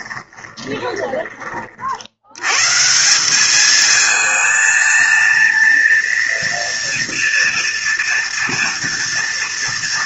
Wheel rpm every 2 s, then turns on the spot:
10, 150, 230, 230, 230.
0-2